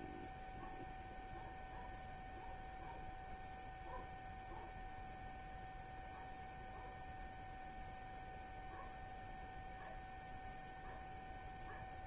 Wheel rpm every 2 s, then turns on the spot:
0, 0, 0, 0, 0, 0.
none